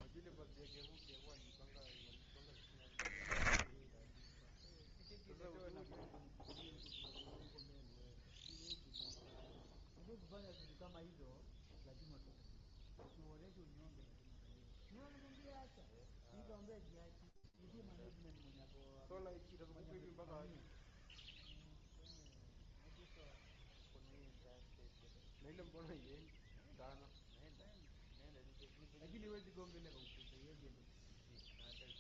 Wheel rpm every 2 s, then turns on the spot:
0, 0, 0, 0, 0, 0, 0, 0, 0, 0, 0, 0, 0, 0, 0, 0.
none